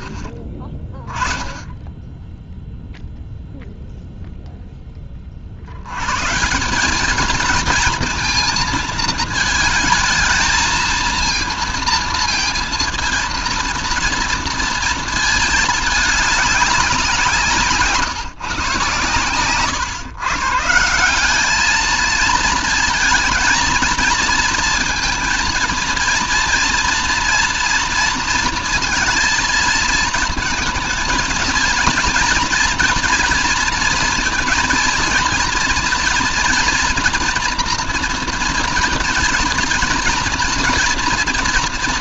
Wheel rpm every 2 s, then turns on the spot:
10, 0, 0, 160, 220, 220, 230, 230, 200, 150, 150, 230, 230, 240, 230, 230, 240, 230, 240, 230, 230.
none